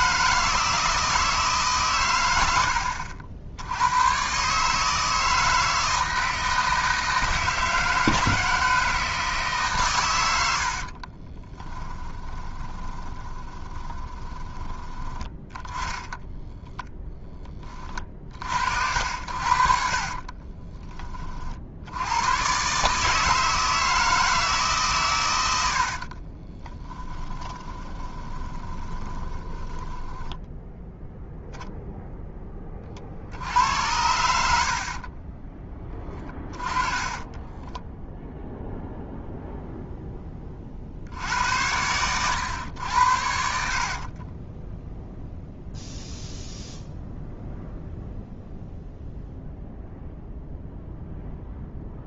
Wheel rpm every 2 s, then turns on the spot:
160, 80, 150, 160, 160, 50, 20, 10, 0, 60, 30, 130, 150, 30, 20, 0, 30, 60, 20, 0, 50, 90, 10, 0, 0, 0.
10-14 20-22 26-30 34-38 44-46